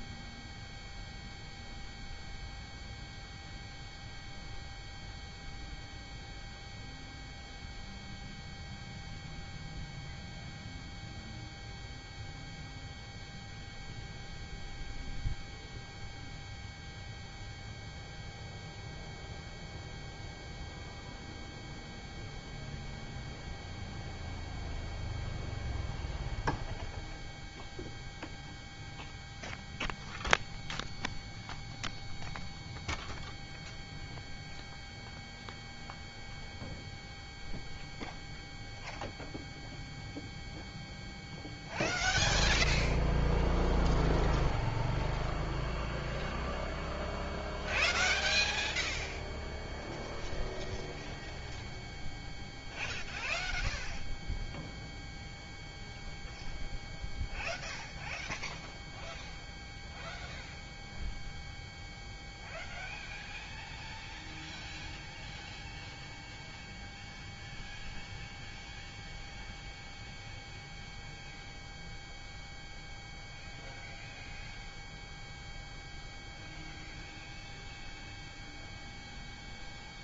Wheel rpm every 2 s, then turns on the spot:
0, 0, 0, 0, 0, 0, 0, 0, 0, 0, 0, 0, 0, 0, 0, 0, 0, 0, 0, 0, 0, 0, 0, 0, 0, 0, 0, 0, 0, 0, 0, 0, 0, 0, 0, 0, 0, 0, 0, 0.
none